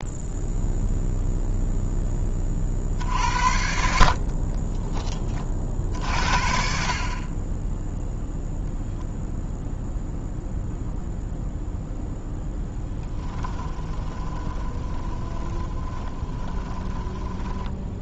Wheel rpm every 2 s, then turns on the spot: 0, 50, 20, 50, 0, 0, 10, 20, 10.
4-6 12-18